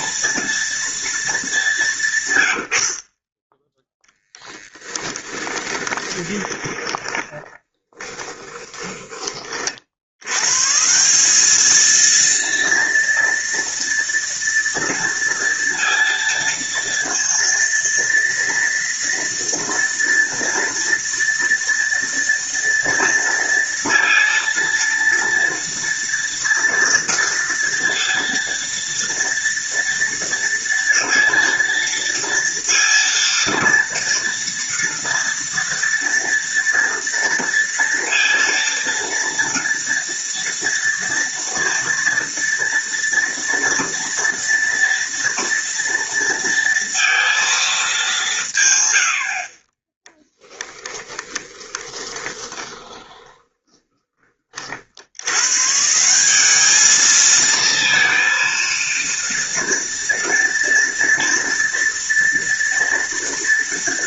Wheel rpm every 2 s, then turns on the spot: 230, 40, 10, 30, 20, 180, 230, 230, 230, 230, 230, 230, 230, 230, 230, 230, 230, 230, 230, 230, 240, 230, 230, 230, 70, 10, 20, 90, 220, 230, 240, 230.
4-8 50-54